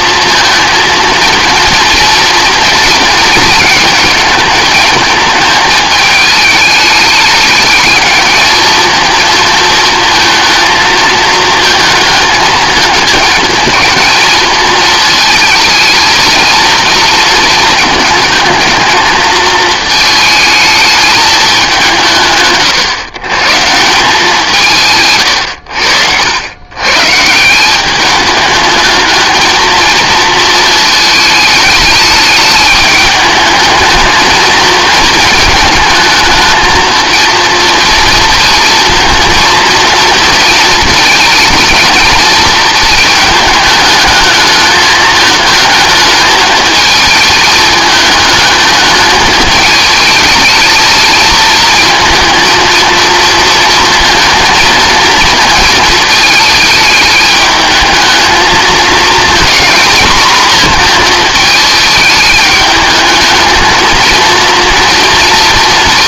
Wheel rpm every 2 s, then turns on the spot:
230, 230, 220, 210, 220, 220, 220, 220, 230, 220, 220, 110, 170, 100, 210, 220, 210, 220, 220, 230, 220, 220, 220, 220, 220, 220, 230, 230, 220, 220, 230, 210, 230.
none